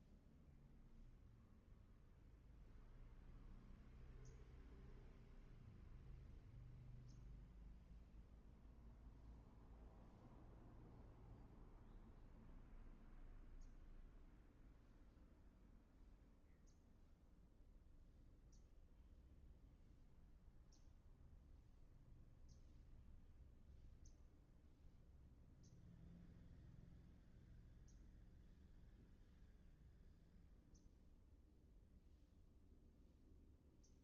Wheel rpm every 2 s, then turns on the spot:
0, 0, 0, 0, 0, 0, 0, 0, 0, 0, 0, 0, 0, 0, 0, 0, 0.
none